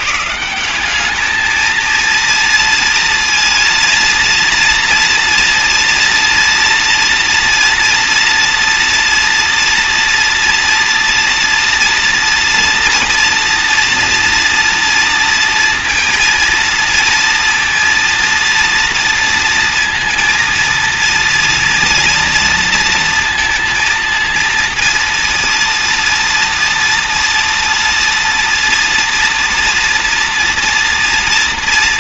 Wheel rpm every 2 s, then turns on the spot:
170, 230, 230, 230, 230, 230, 240, 240, 230, 230, 230, 230, 230, 230, 230, 230.
none